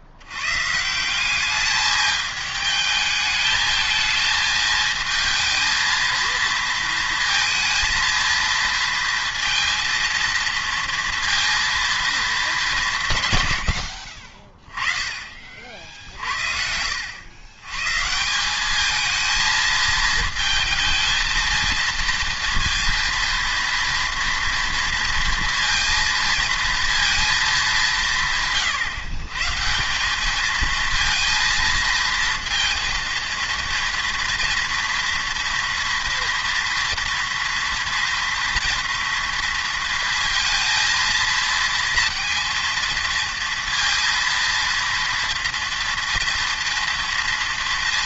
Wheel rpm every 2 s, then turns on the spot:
150, 220, 220, 230, 230, 230, 180, 30, 70, 200, 230, 230, 230, 230, 140, 220, 230, 230, 230, 230, 230, 230, 230, 230.
16-18